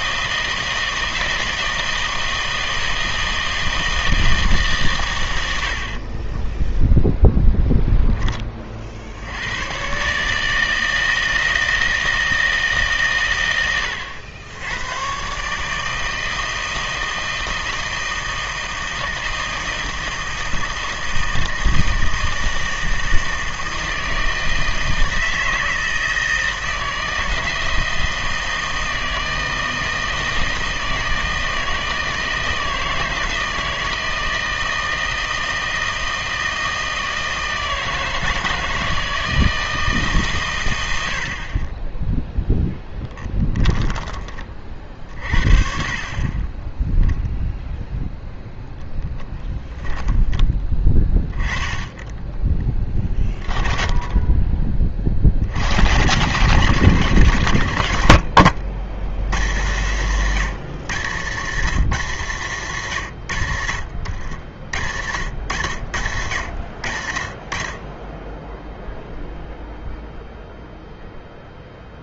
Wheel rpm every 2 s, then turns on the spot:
160, 160, 140, 10, 30, 160, 160, 90, 160, 160, 160, 160, 160, 160, 160, 160, 160, 160, 160, 160, 110, 10, 30, 10, 0, 10, 10, 20, 110, 70, 160, 150, 90, 90, 0, 0.
6-8